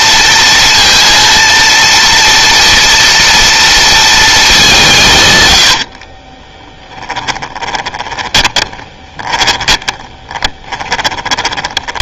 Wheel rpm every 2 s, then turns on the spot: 230, 230, 170, 10, 20, 20.
6-12